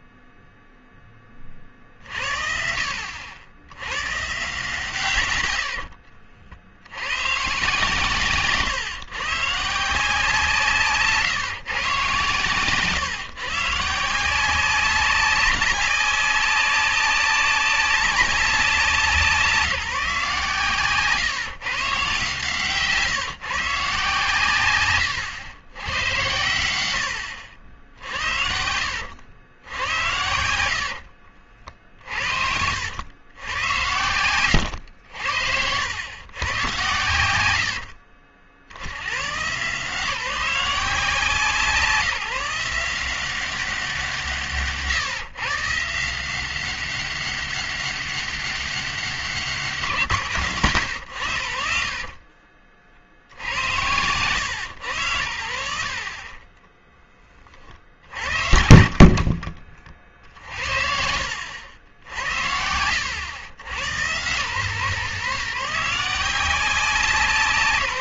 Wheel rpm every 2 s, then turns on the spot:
0, 60, 140, 80, 130, 150, 140, 190, 190, 190, 140, 150, 120, 100, 70, 70, 80, 100, 110, 70, 170, 170, 150, 190, 200, 120, 50, 100, 20, 60, 70, 90, 140, 180.
34-36 58-60